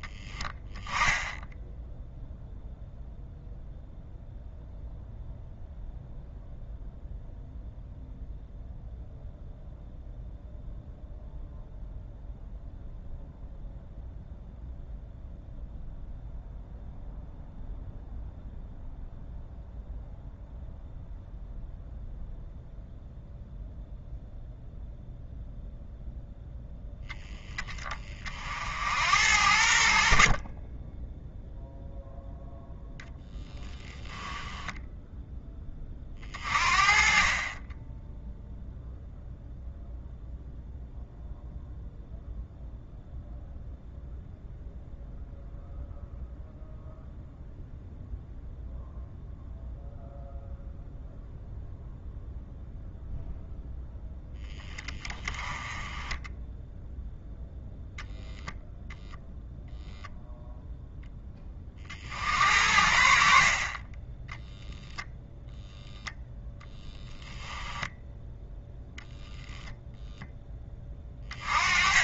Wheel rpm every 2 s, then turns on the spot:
10, 0, 0, 0, 0, 0, 0, 0, 0, 0, 0, 0, 0, 0, 40, 50, 0, 10, 30, 0, 0, 0, 0, 0, 0, 0, 0, 10, 10, 0, 0, 50, 10, 0, 0, 10.
34-36